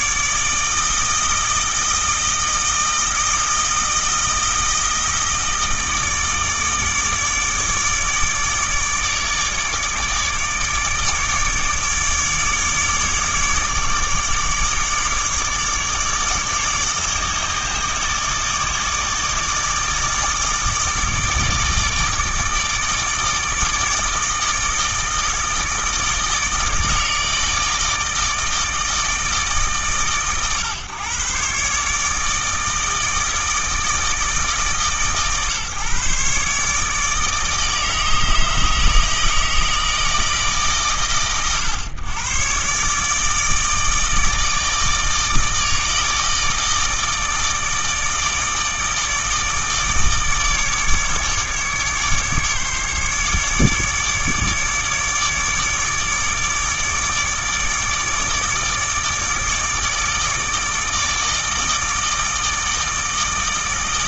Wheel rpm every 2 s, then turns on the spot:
160, 160, 160, 150, 150, 150, 150, 150, 150, 150, 150, 160, 160, 160, 160, 120, 160, 150, 150, 160, 130, 130, 160, 160, 150, 150, 150, 150, 150, 150, 150, 160.
none